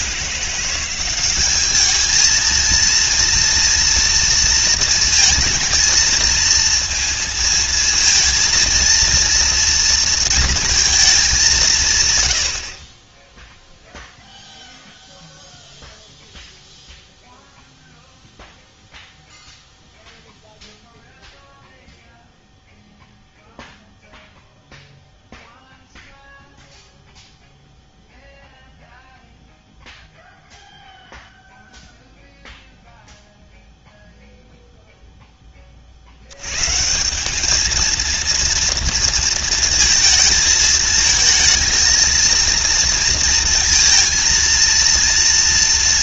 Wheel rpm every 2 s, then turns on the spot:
170, 220, 230, 230, 230, 230, 80, 0, 0, 0, 0, 0, 0, 0, 0, 0, 0, 0, 120, 230, 220, 230, 230.
none